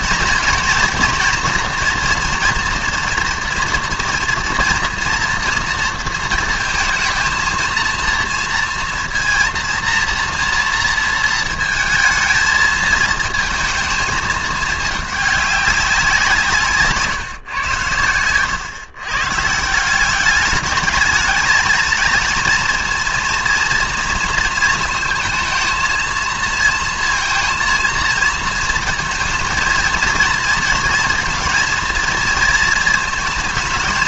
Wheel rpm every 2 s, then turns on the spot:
230, 240, 230, 230, 230, 230, 220, 210, 150, 120, 210, 230, 220, 230, 230, 230, 220.
none